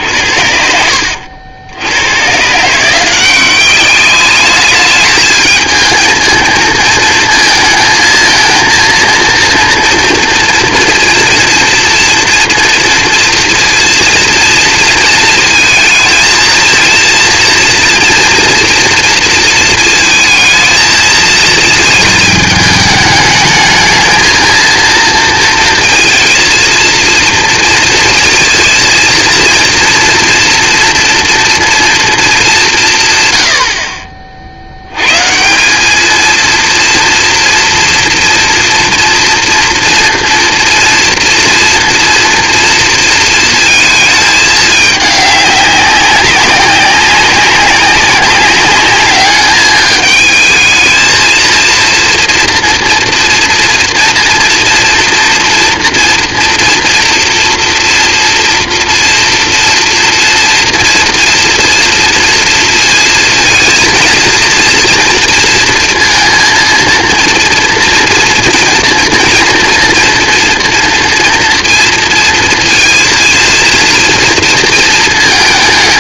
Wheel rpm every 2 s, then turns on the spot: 70, 130, 210, 220, 230, 230, 230, 230, 230, 230, 220, 210, 230, 230, 230, 230, 210, 60, 230, 230, 240, 230, 210, 190, 200, 220, 230, 230, 230, 230, 230, 230, 230, 230, 240, 230, 230, 230.
none